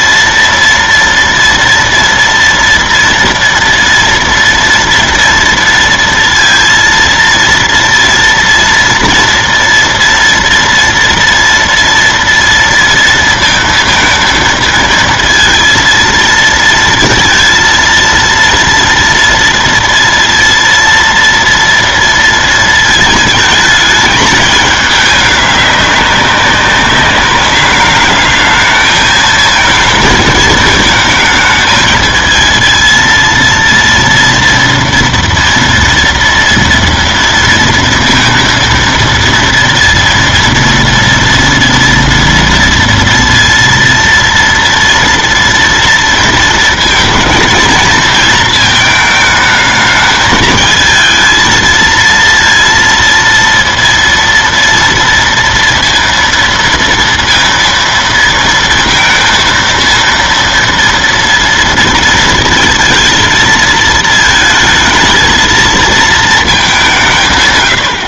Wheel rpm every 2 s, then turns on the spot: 230, 230, 230, 230, 230, 230, 230, 230, 230, 230, 230, 230, 220, 200, 210, 220, 220, 230, 230, 230, 230, 230, 230, 230, 230, 210, 230, 230, 230, 230, 230, 230, 220, 220.
none